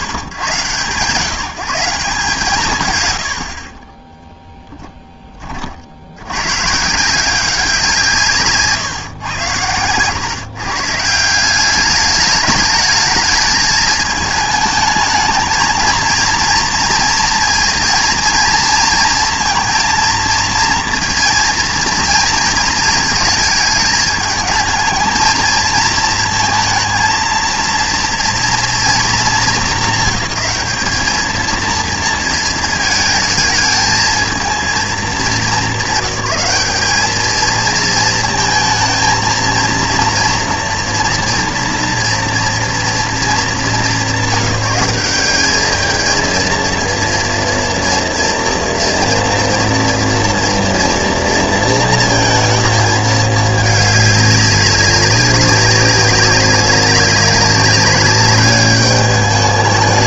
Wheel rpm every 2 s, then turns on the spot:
110, 140, 10, 170, 120, 160, 210, 220, 230, 230, 230, 220, 220, 230, 220, 210, 220, 210, 220, 230, 230, 220, 200, 230, 230, 230, 220, 190, 200, 210.
none